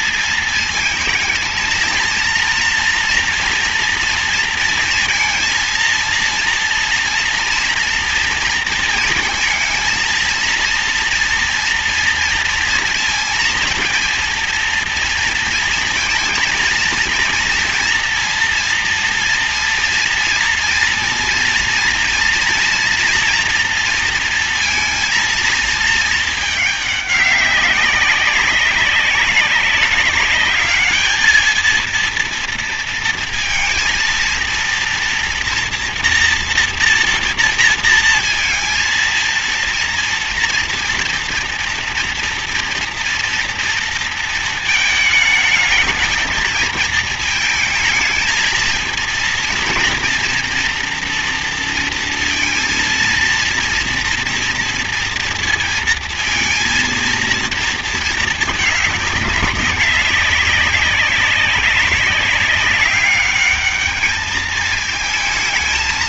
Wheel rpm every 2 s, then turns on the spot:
230, 230, 230, 230, 230, 230, 230, 230, 230, 230, 230, 230, 230, 210, 190, 210, 230, 230, 230, 220, 230, 240, 220, 220, 230, 240, 230, 230, 230, 210, 200, 200, 220.
none